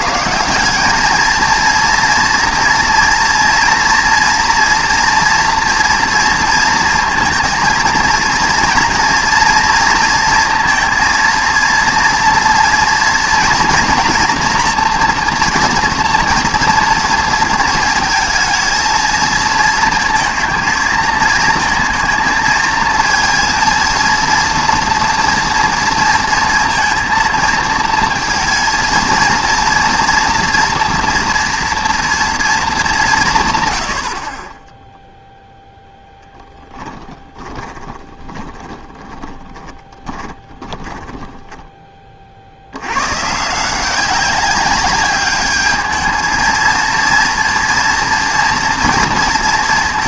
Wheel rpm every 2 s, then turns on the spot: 190, 230, 230, 230, 230, 230, 230, 230, 230, 220, 220, 230, 230, 230, 230, 230, 220, 10, 10, 20, 20, 80, 200, 230, 230.
36-42